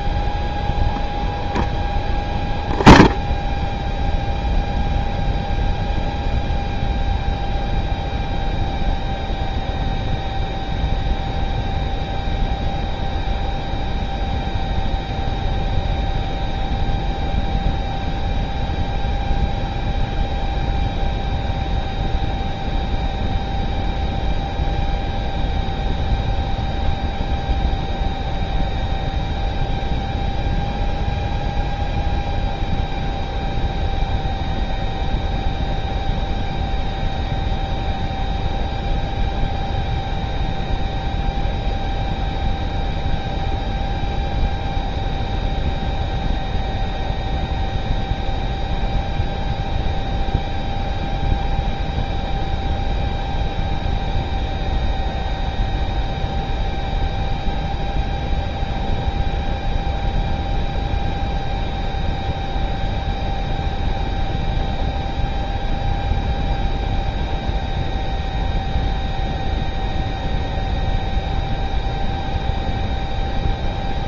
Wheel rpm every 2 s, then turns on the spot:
0, 0, 0, 0, 0, 0, 0, 0, 0, 0, 0, 0, 0, 0, 0, 0, 0, 0, 0, 0, 0, 0, 0, 0, 0, 0, 0, 0, 0, 0, 0, 0, 0, 0, 0, 0, 0.
none